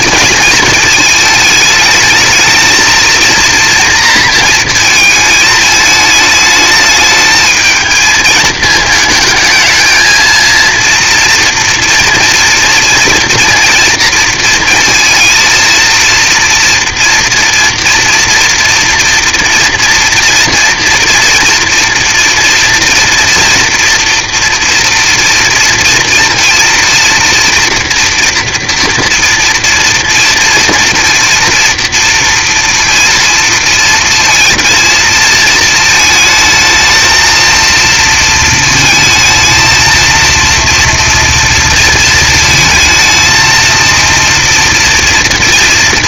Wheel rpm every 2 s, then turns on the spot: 220, 220, 230, 220, 220, 230, 240, 230, 230, 230, 230, 230, 240, 230, 230, 230, 230, 230, 220, 230, 230, 220, 230.
none